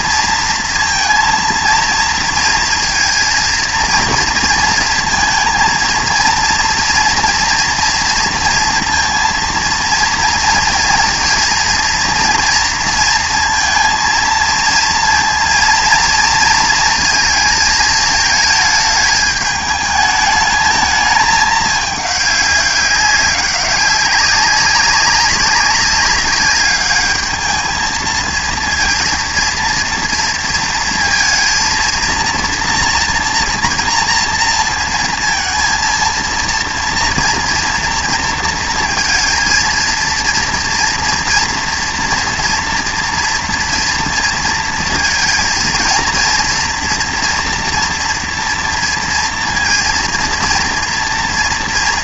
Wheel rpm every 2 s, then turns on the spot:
230, 230, 230, 230, 230, 230, 230, 230, 230, 220, 220, 200, 200, 200, 230, 230, 230, 220, 230, 230, 230, 240, 230, 230, 230, 230.
none